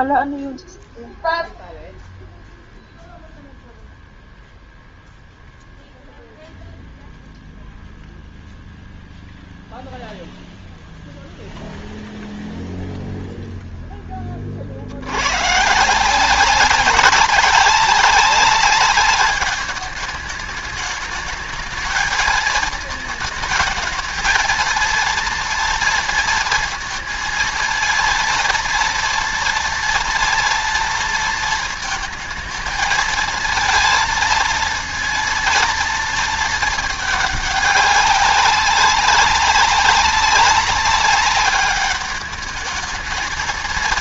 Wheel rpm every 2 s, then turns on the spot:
0, 0, 0, 0, 0, 0, 0, 50, 190, 200, 210, 220, 230, 230, 230, 230, 220, 230, 220, 200, 200, 220.
none